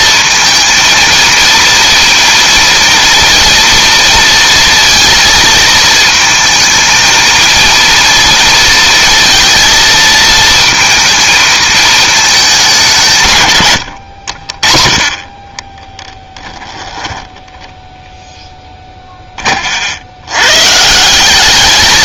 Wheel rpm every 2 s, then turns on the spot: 230, 230, 230, 230, 230, 230, 200, 30, 10, 10, 140.
16-18